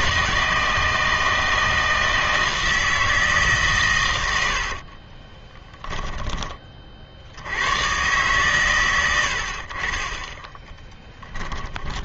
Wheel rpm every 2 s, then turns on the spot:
160, 160, 60, 40, 100, 10.
4-6 10-12